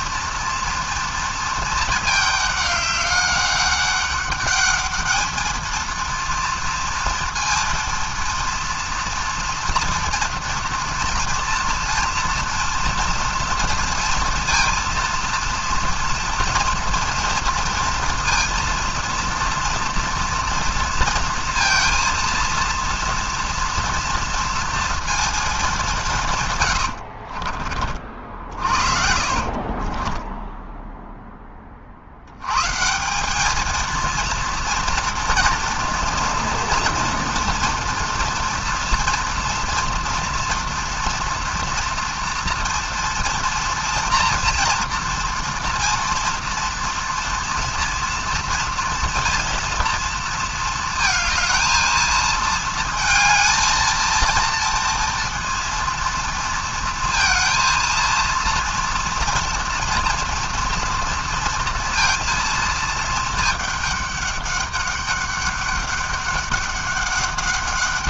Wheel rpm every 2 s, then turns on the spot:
230, 200, 210, 230, 230, 230, 240, 230, 230, 230, 230, 230, 230, 90, 50, 10, 140, 230, 240, 230, 230, 240, 230, 230, 230, 230, 220, 230, 220, 230, 230, 230, 200, 200.
26-32